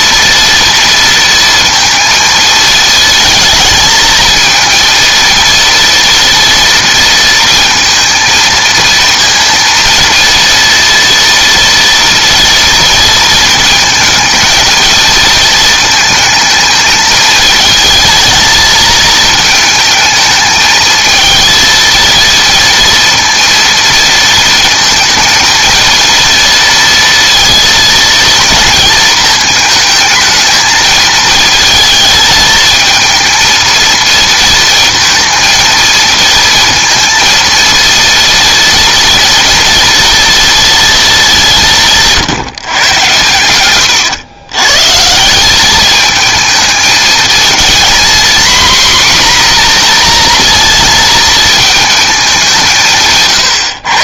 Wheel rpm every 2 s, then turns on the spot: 230, 220, 230, 230, 230, 240, 230, 220, 220, 220, 220, 230, 220, 230, 230, 220, 220, 230, 230, 230, 230, 140, 140, 220, 250, 230, 170.
none